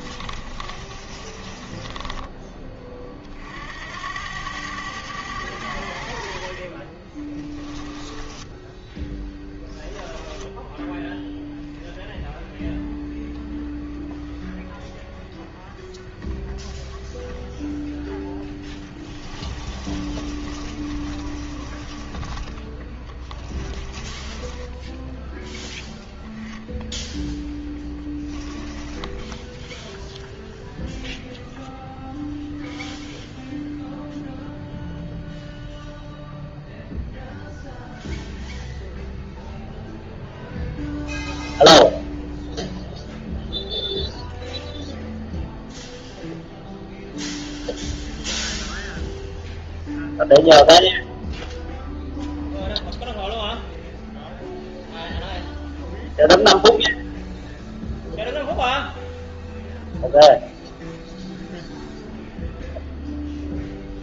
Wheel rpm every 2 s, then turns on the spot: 30, 30, 100, 20, 10, 0, 10, 20, 10, 10, 30, 20, 10, 0, 10, 0, 0, 0, 0, 0, 0, 0, 0, 0, 0, 0, 0, 0, 0, 0, 0, 0.
0-2 6-8 18-26 28-30